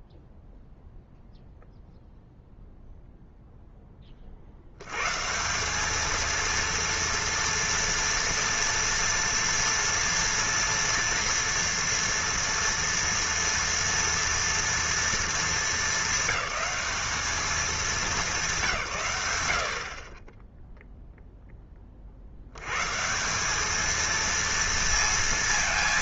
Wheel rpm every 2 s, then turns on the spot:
0, 0, 80, 230, 230, 230, 230, 230, 210, 180, 10, 100, 230.
none